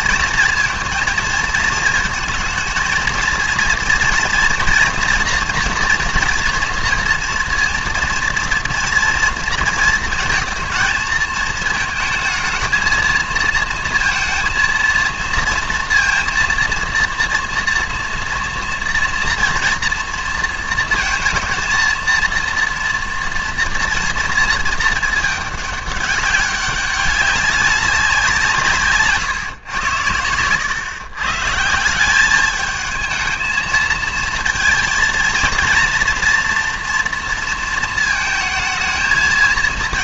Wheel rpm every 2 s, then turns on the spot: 230, 230, 230, 230, 230, 230, 220, 230, 230, 230, 230, 230, 220, 190, 160, 120, 210, 230, 240, 220.
none